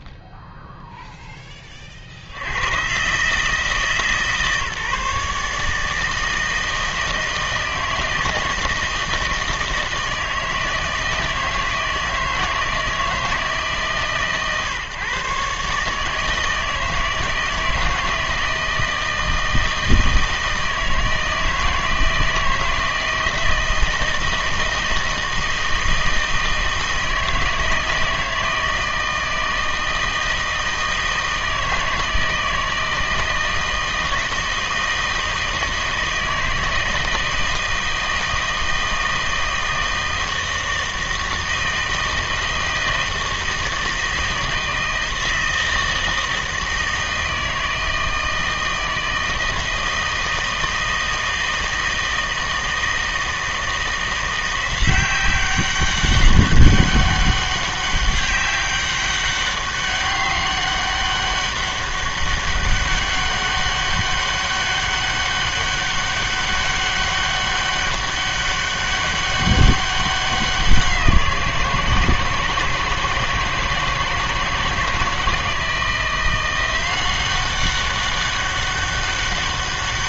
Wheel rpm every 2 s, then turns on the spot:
0, 100, 150, 160, 160, 160, 160, 140, 160, 160, 160, 160, 160, 160, 160, 160, 160, 160, 160, 160, 160, 160, 160, 160, 160, 160, 160, 180, 200, 200, 200, 200, 200, 200, 200, 180, 160, 160, 180, 200.
none